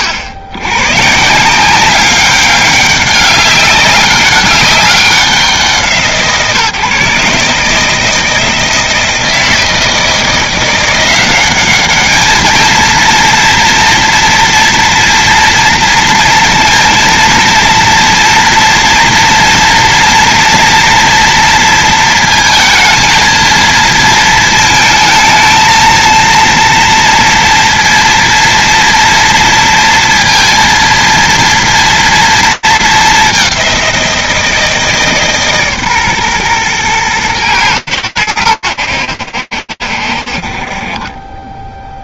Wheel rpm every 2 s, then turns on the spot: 100, 200, 200, 140, 160, 180, 230, 240, 230, 230, 230, 230, 220, 230, 240, 230, 210, 160, 120, 90, 40.
none